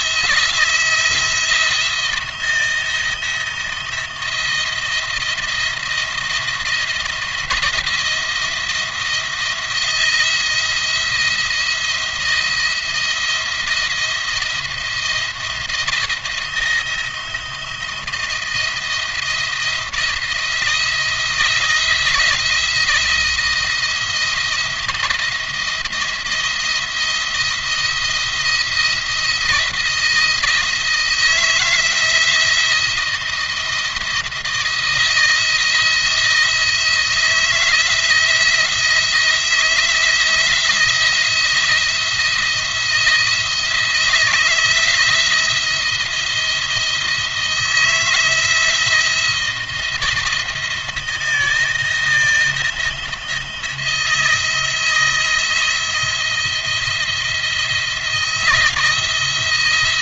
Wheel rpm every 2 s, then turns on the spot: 160, 170, 170, 170, 170, 170, 170, 170, 160, 170, 170, 160, 170, 170, 170, 160, 170, 160, 170, 170, 170, 170, 160, 170, 160, 170, 170, 160, 170, 170.
none